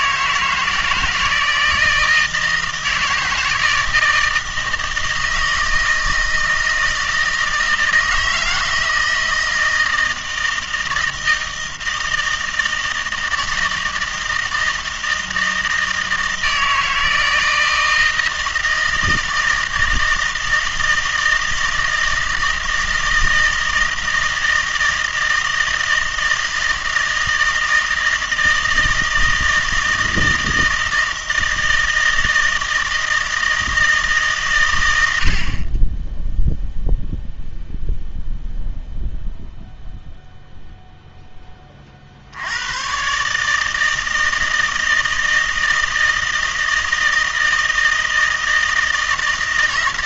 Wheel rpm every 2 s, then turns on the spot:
160, 160, 160, 160, 160, 160, 160, 160, 160, 160, 160, 160, 160, 160, 160, 160, 160, 120, 0, 0, 0, 100, 160, 160, 160.
none